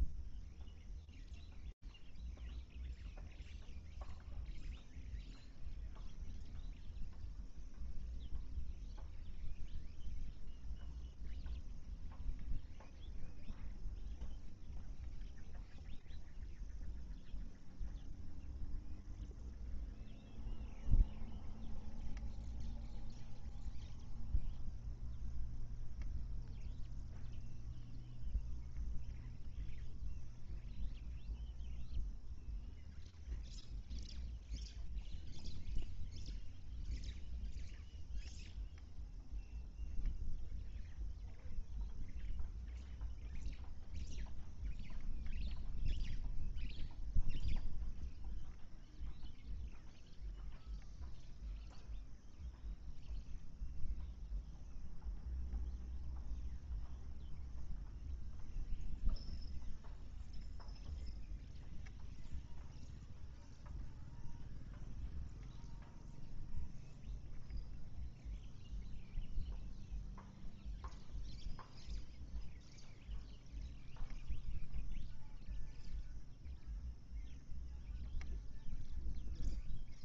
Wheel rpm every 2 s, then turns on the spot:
0, 0, 0, 0, 0, 0, 0, 0, 0, 0, 0, 0, 0, 0, 0, 0, 0, 0, 0, 0, 0, 0, 0, 0, 0, 0, 0, 0, 0, 0, 0, 0, 0, 0, 0, 0, 0, 0, 0, 0.
none